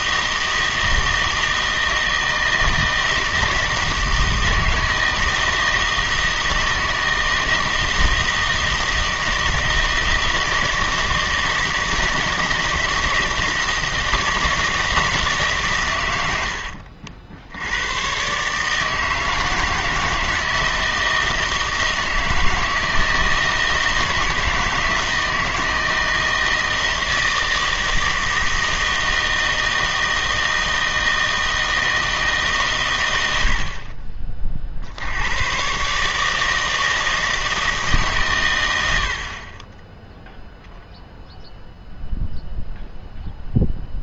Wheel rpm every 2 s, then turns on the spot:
160, 160, 160, 160, 160, 160, 160, 160, 80, 150, 160, 160, 160, 160, 160, 160, 140, 50, 160, 100, 10, 0.
16-18